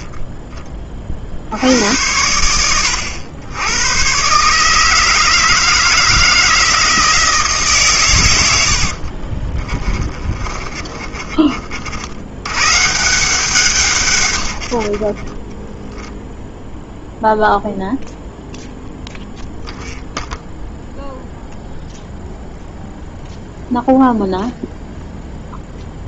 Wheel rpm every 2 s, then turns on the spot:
30, 100, 150, 160, 80, 30, 140, 80, 0, 0, 0, 0, 0.
10-12 14-16